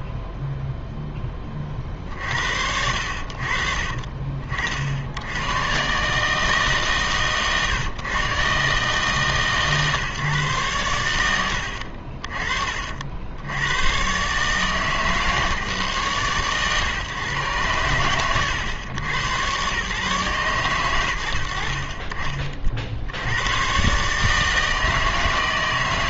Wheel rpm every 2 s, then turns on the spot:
0, 60, 60, 150, 140, 110, 50, 150, 130, 100, 120, 50, 160.
none